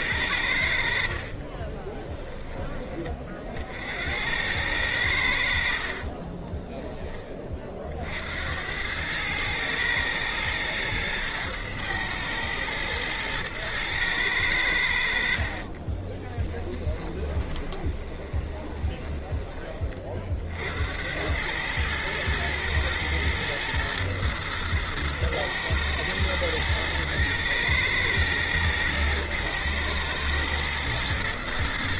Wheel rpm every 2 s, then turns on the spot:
80, 20, 90, 30, 80, 110, 110, 100, 20, 20, 60, 110, 120, 110, 110, 110.
6-8 16-20